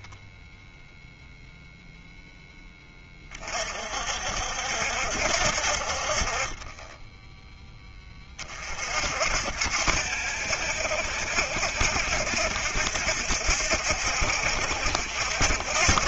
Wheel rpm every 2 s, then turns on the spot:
0, 10, 60, 20, 40, 70, 70, 70.
none